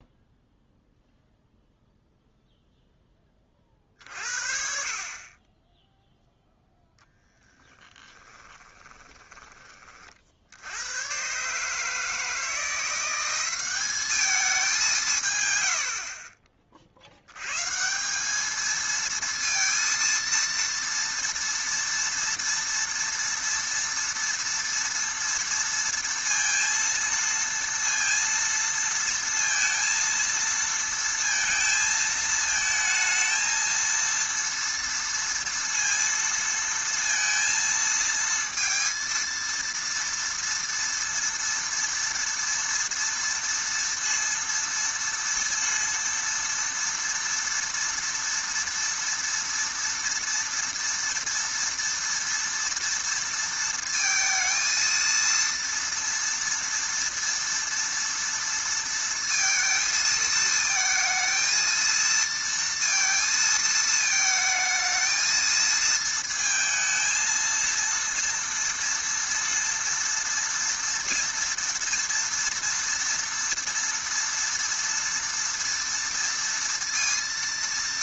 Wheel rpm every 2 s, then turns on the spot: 0, 0, 40, 0, 20, 90, 170, 190, 40, 220, 230, 230, 230, 230, 230, 230, 220, 230, 230, 230, 230, 230, 230, 230, 230, 230, 230, 230, 230, 230, 220, 230, 220, 230, 230, 230, 230, 230, 230.
8-10